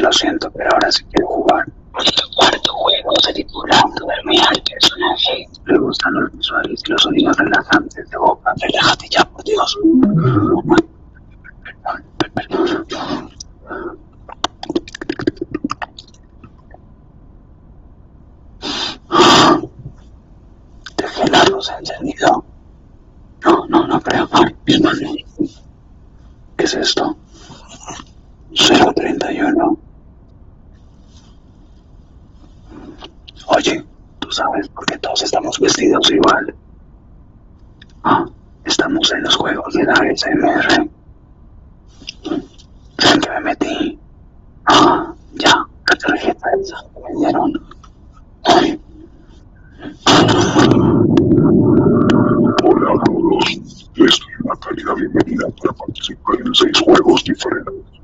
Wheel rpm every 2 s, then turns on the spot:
0, 0, 0, 0, 0, 0, 0, 0, 0, 0, 0, 0, 0, 0, 0, 0, 0, 0, 0, 0, 0, 0, 0, 0, 0, 0, 0, 0, 0.
none